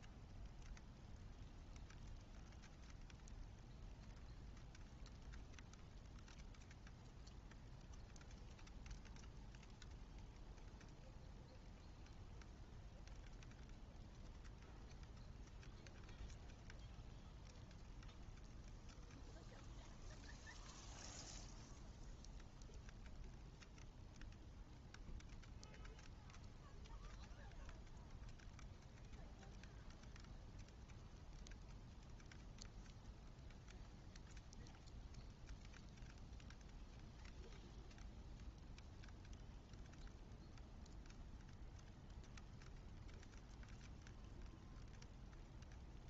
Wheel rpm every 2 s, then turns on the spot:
0, 0, 0, 0, 0, 0, 0, 0, 0, 0, 0, 0, 0, 0, 0, 0, 0, 0, 0, 0, 0, 0, 0.
none